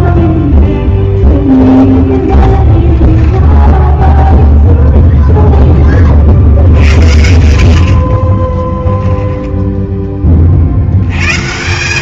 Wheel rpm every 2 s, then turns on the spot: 10, 10, 0, 80, 10, 140.
2-4 6-8